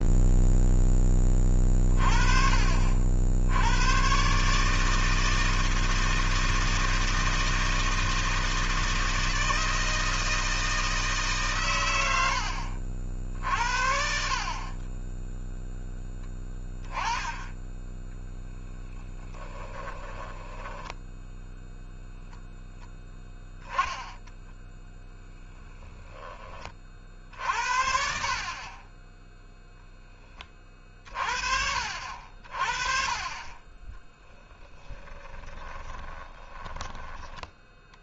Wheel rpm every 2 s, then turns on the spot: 10, 60, 160, 160, 160, 160, 60, 20, 10, 10, 10, 0, 10, 40, 20, 40, 40, 20, 10.
14-16 18-22 34-38